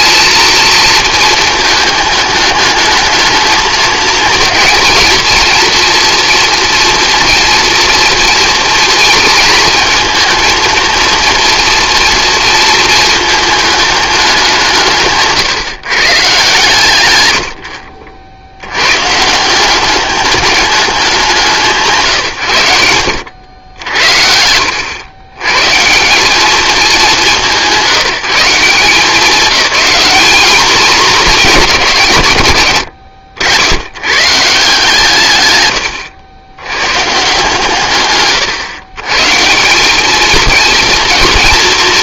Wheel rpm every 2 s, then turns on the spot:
220, 210, 220, 230, 230, 230, 220, 180, 130, 90, 200, 100, 80, 210, 180, 220, 130, 150, 100, 140, 230.
none